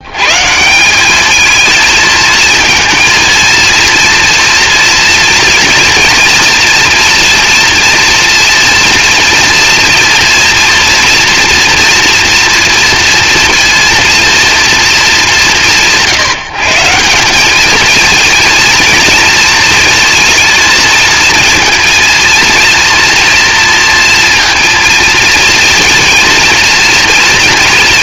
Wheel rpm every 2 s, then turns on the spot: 190, 230, 230, 230, 230, 240, 230, 190, 180, 230, 220, 230, 230, 230.
none